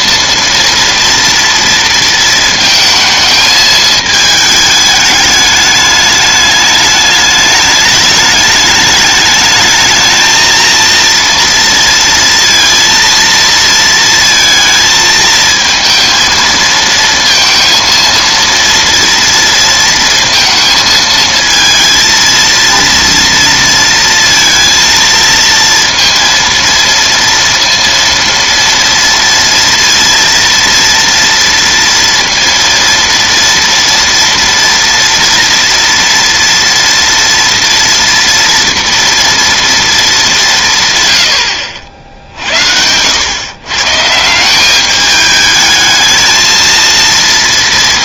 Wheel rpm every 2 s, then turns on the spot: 230, 230, 210, 210, 210, 230, 230, 220, 230, 230, 220, 230, 230, 230, 230, 230, 230, 230, 230, 230, 140, 80, 200, 230.
none